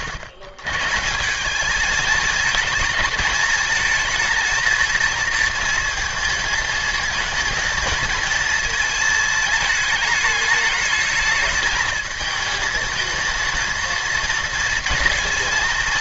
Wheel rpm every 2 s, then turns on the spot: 160, 220, 230, 220, 230, 220, 220, 230.
none